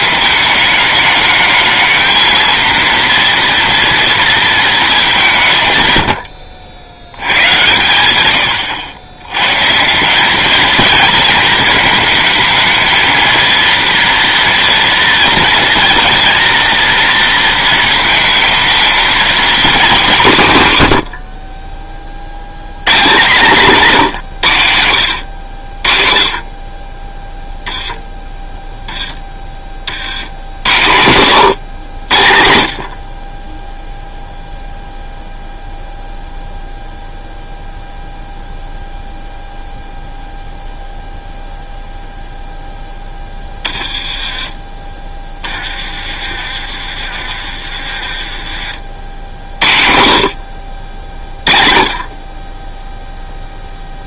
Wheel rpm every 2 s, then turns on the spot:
210, 230, 210, 80, 100, 230, 220, 230, 230, 230, 130, 150, 90, 30, 10, 90, 50, 0, 0, 0, 0, 0, 20, 30, 50, 60, 20.
none